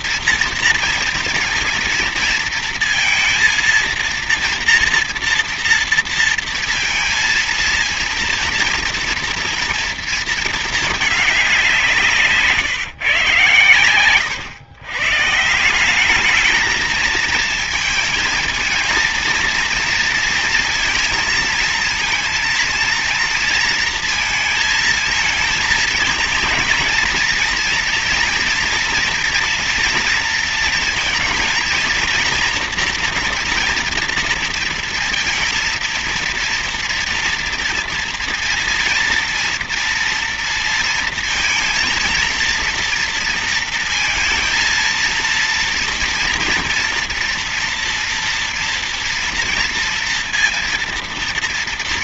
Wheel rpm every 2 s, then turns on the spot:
230, 230, 230, 230, 230, 220, 150, 120, 210, 220, 230, 230, 220, 230, 230, 230, 230, 230, 230, 230, 230, 230, 230, 230, 240, 230.
none